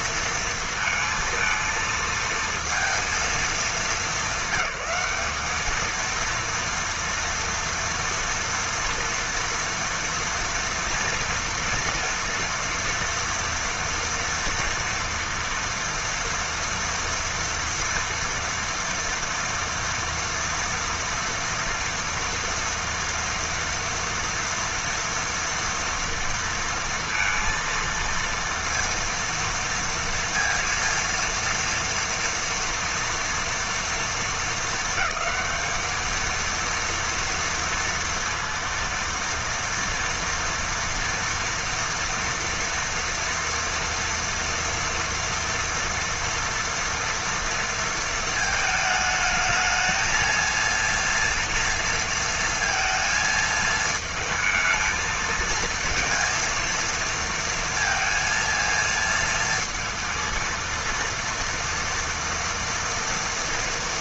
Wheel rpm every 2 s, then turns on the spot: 230, 230, 210, 230, 230, 230, 230, 230, 230, 230, 230, 230, 230, 230, 230, 230, 230, 220, 230, 230, 230, 230, 230, 230, 220, 230, 230, 220, 230, 230, 230, 230.
none